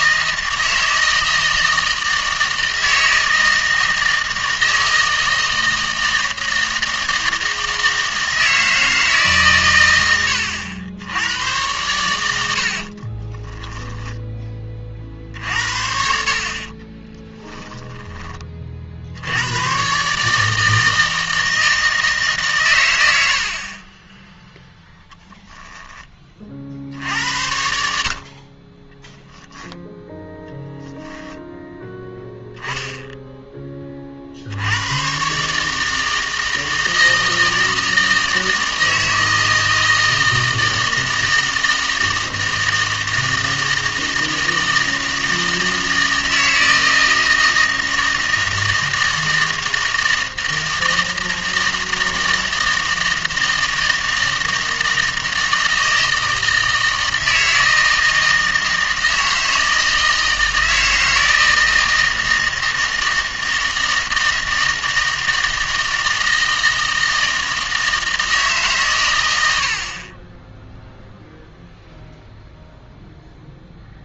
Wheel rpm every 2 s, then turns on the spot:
160, 160, 160, 160, 160, 90, 60, 40, 20, 50, 160, 110, 0, 60, 20, 0, 10, 90, 160, 160, 160, 160, 160, 160, 160, 160, 160, 160, 160, 160, 160, 160, 160, 160, 130, 0, 0.
12-14 16-18